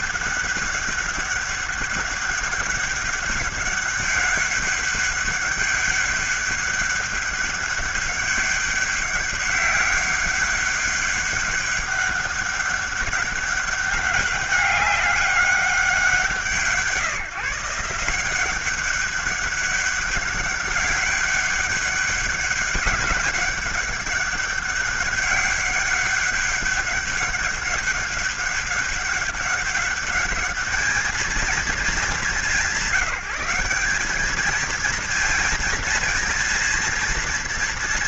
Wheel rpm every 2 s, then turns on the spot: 200, 200, 200, 200, 200, 200, 200, 190, 160, 180, 190, 200, 200, 200, 200, 200, 170, 220, 230.
none